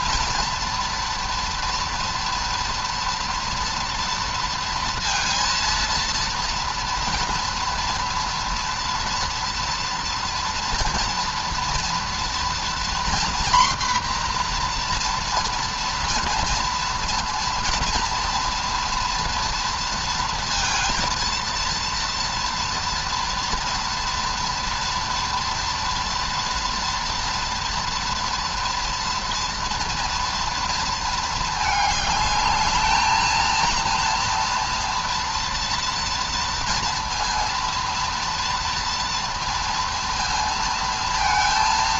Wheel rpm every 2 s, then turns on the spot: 230, 230, 230, 230, 230, 240, 240, 240, 240, 230, 230, 230, 230, 230, 230, 230, 210, 240, 230, 230, 230.
none